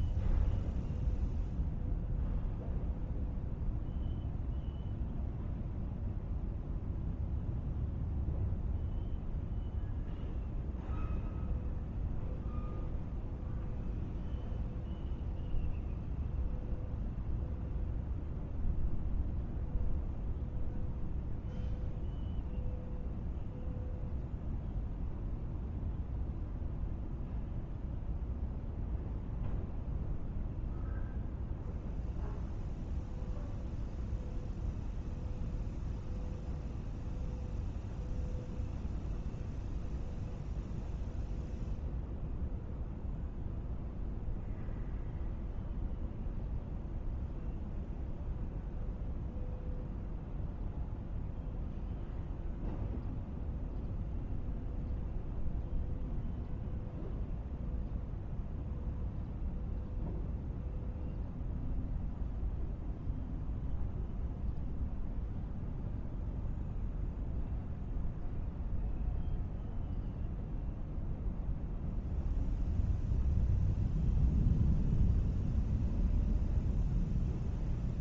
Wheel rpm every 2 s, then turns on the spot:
0, 0, 0, 0, 0, 0, 0, 0, 0, 0, 0, 0, 0, 0, 0, 0, 0, 0, 0, 0, 0, 0, 0, 0, 0, 0, 0, 0, 0, 0, 0, 0, 0, 0, 0, 0, 0, 0, 0.
none